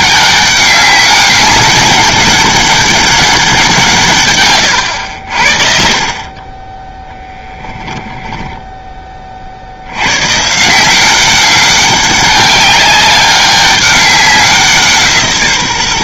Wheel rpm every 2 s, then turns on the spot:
200, 200, 110, 10, 10, 160, 200, 170.
4-6